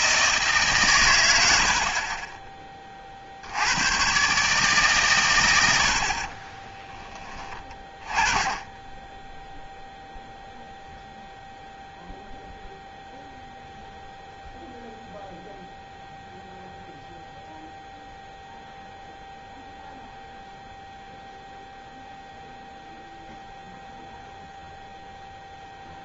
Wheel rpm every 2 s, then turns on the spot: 130, 30, 140, 20, 10, 0, 0, 0, 0, 0, 0, 0, 0.
6-8